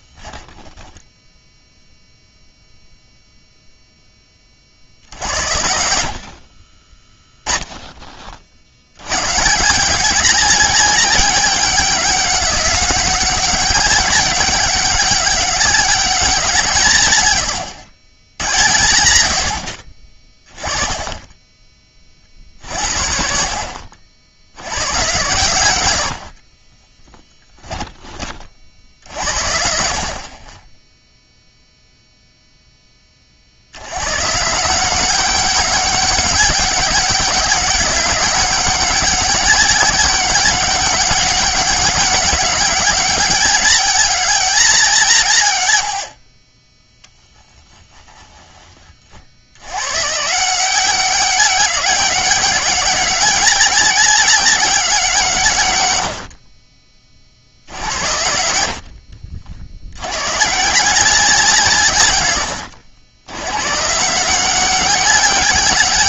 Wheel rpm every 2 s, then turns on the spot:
10, 0, 50, 40, 90, 200, 200, 200, 160, 90, 20, 70, 110, 30, 60, 10, 10, 170, 200, 200, 190, 210, 210, 20, 30, 180, 200, 190, 30, 70, 160, 110, 190.
0-2 6-8 22-24 26-28